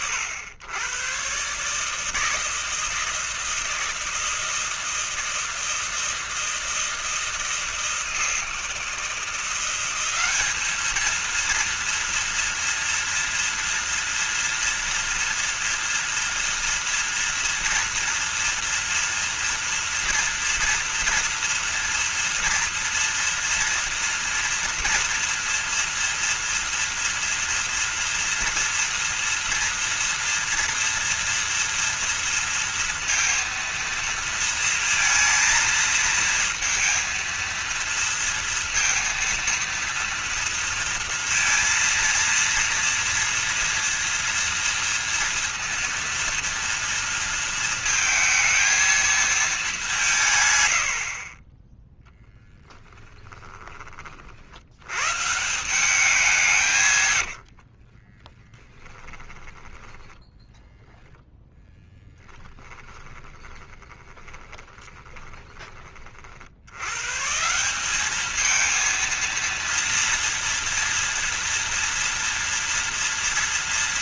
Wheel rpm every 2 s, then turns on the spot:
110, 160, 160, 160, 160, 210, 230, 230, 230, 230, 230, 240, 240, 230, 230, 230, 230, 230, 230, 230, 230, 230, 230, 230, 220, 100, 0, 90, 150, 10, 0, 20, 10, 90, 220, 230, 230.
58-60 62-66